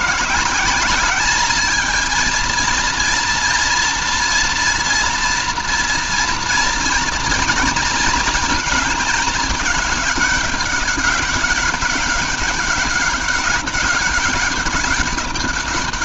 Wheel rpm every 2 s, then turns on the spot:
200, 230, 230, 230, 220, 200, 190, 190.
none